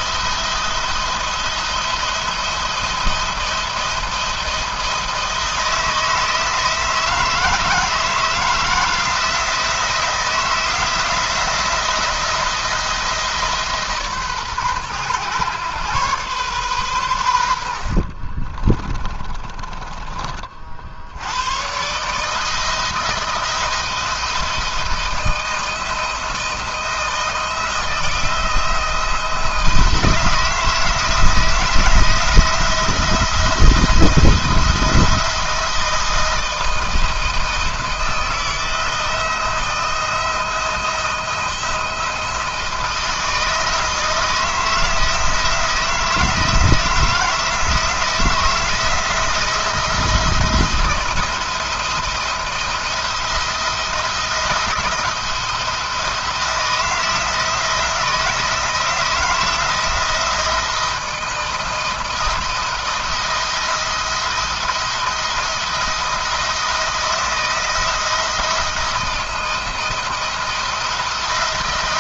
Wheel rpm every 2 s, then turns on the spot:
170, 170, 170, 160, 160, 170, 170, 130, 120, 40, 50, 160, 160, 160, 170, 160, 170, 170, 170, 160, 170, 170, 160, 160, 160, 170, 170, 170, 170, 160, 170, 170, 170, 170, 170, 160.
18-20